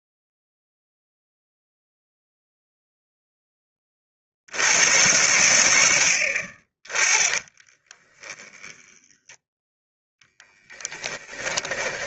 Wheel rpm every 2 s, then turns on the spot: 0, 0, 90, 30, 10, 10.
8-12